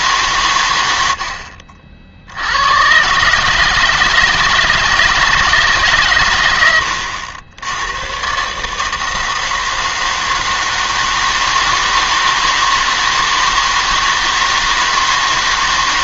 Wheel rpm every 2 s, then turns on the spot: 100, 120, 160, 90, 150, 160, 160, 160.
none